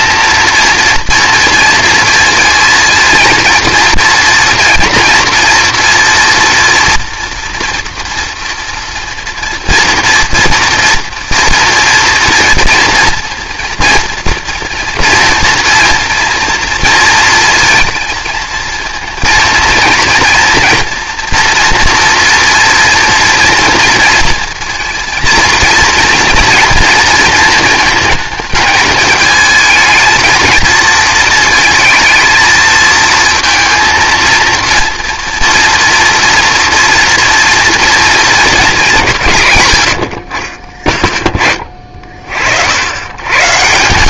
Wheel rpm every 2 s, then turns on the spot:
230, 230, 230, 230, 230, 230, 230, 240, 230, 230, 230, 230, 230, 230, 220, 220, 220, 230, 230, 160, 30, 130.
none